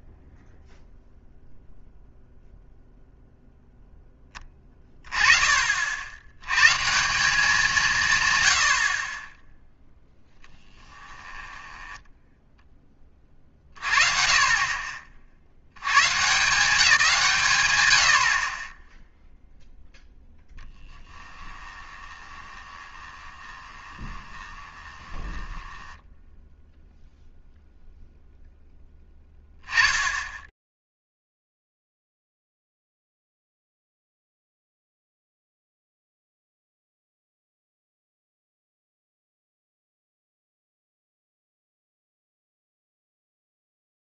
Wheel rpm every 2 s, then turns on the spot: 0, 0, 20, 120, 100, 20, 10, 30, 170, 30, 20, 20, 20, 0, 0, 0, 50, 0, 0, 140, 120, 0.
10-12 20-26